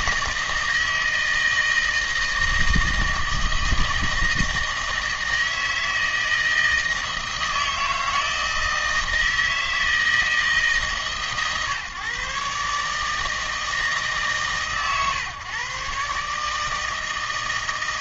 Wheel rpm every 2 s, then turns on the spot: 160, 160, 160, 160, 160, 150, 140, 130, 150.
none